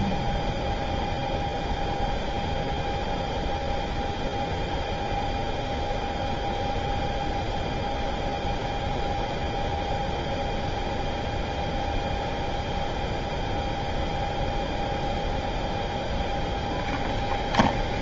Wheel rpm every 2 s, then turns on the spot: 0, 0, 0, 0, 0, 0, 0, 0, 0.
none